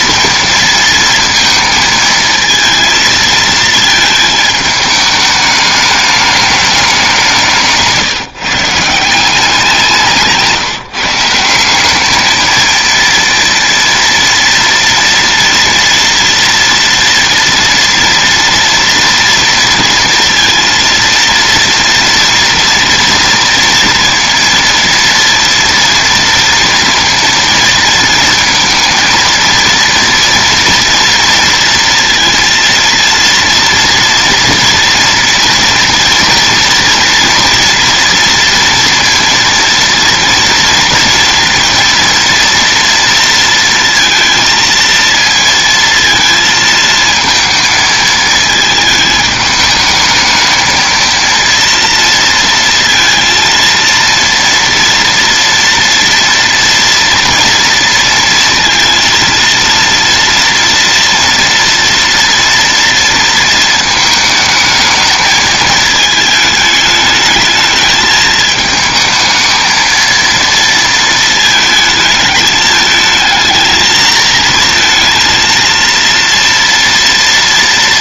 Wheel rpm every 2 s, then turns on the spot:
230, 220, 220, 210, 170, 160, 220, 230, 230, 230, 230, 230, 230, 230, 230, 230, 230, 240, 230, 230, 230, 230, 230, 230, 220, 220, 230, 230, 230, 230, 230, 230, 220, 220, 220, 230, 210, 230, 230.
none